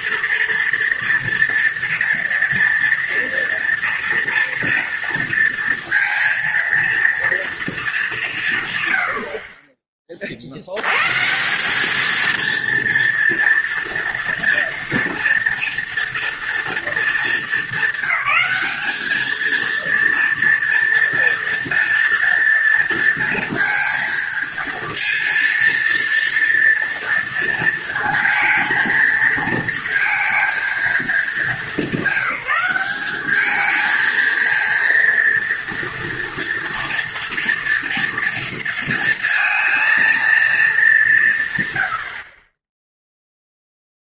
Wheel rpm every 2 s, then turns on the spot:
230, 230, 230, 230, 120, 90, 230, 230, 230, 210, 230, 230, 230, 230, 230, 220, 200, 230, 230, 230, 210, 10.
none